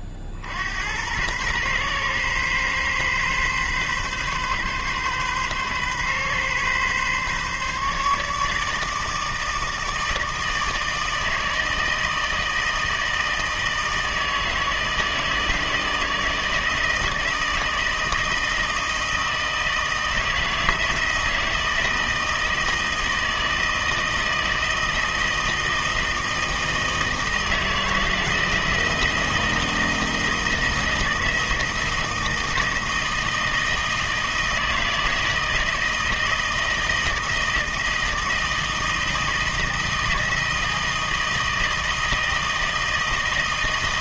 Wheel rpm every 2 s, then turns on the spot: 60, 130, 130, 130, 150, 160, 160, 160, 160, 160, 160, 160, 160, 160, 160, 160, 160, 160, 160, 160, 160, 160.
none